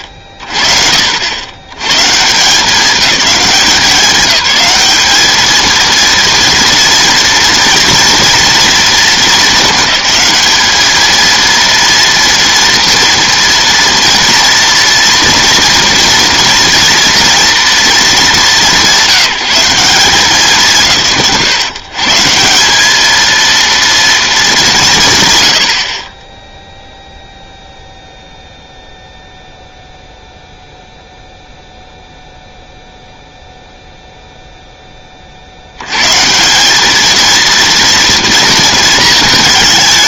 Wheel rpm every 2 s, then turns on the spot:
30, 180, 210, 230, 230, 210, 230, 230, 230, 170, 110, 190, 180, 0, 0, 0, 0, 10, 190, 230.
none